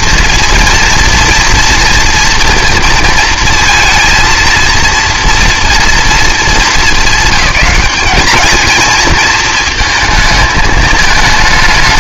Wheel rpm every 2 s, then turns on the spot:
230, 230, 230, 210, 220, 220.
none